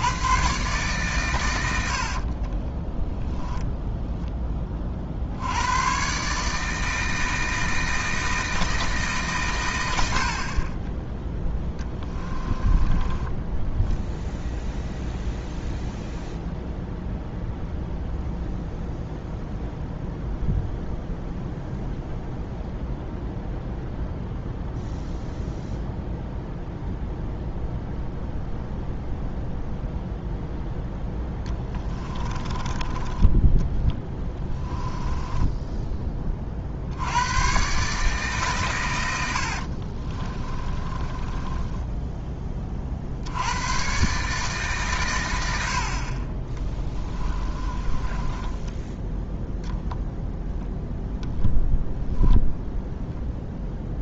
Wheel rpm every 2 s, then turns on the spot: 130, 20, 40, 160, 160, 20, 20, 0, 0, 0, 0, 0, 0, 0, 0, 0, 20, 10, 70, 110, 20, 50, 130, 20, 10, 0, 0.
2-4 12-14 32-36 40-42 46-50